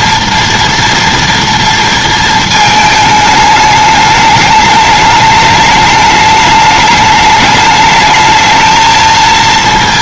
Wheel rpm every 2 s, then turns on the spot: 230, 220, 210, 210, 220.
none